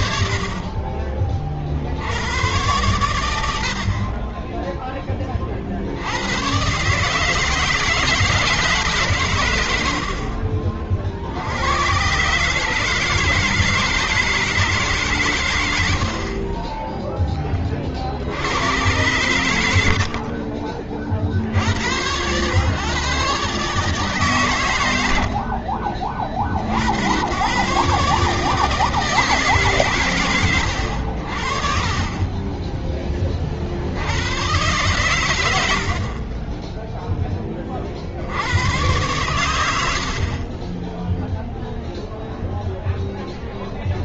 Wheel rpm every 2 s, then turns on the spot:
40, 110, 20, 130, 150, 60, 150, 150, 20, 100, 40, 120, 110, 50, 150, 100, 20, 110, 20, 90, 20, 0.
16-18 32-34 36-38